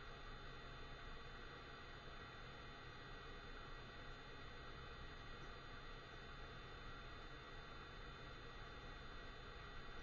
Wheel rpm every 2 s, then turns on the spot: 0, 0, 0, 0, 0.
none